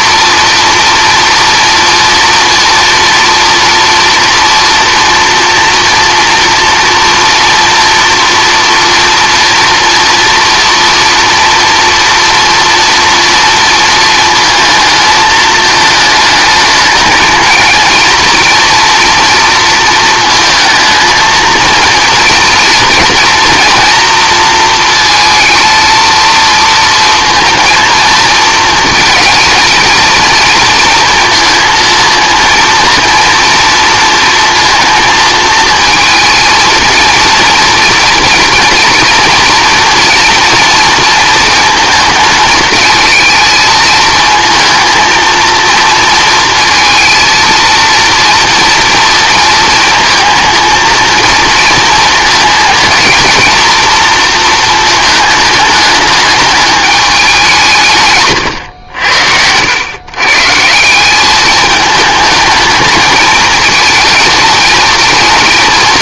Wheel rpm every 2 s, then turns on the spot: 230, 230, 230, 240, 230, 230, 240, 220, 220, 230, 220, 230, 230, 230, 220, 230, 230, 230, 230, 230, 230, 220, 220, 230, 230, 220, 220, 220, 210, 110, 150, 220, 220.
58-60